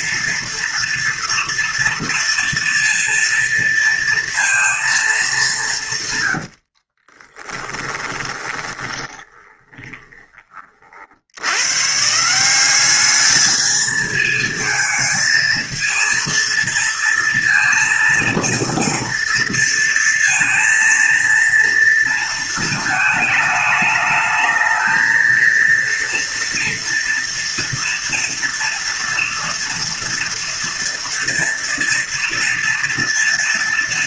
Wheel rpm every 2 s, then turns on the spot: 230, 230, 230, 90, 20, 30, 180, 220, 230, 230, 230, 220, 220, 230, 230, 230, 230.
6-10